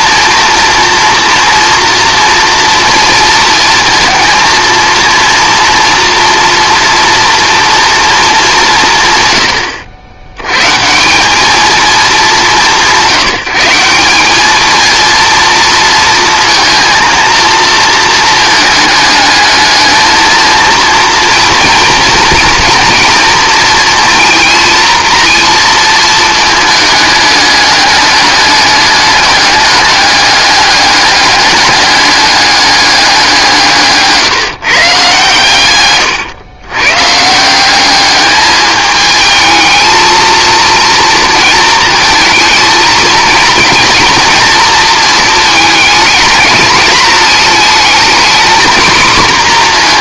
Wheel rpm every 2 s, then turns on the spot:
230, 230, 230, 240, 170, 130, 180, 220, 230, 220, 230, 230, 230, 220, 210, 200, 200, 150, 120, 210, 230, 220, 230, 220, 240.
none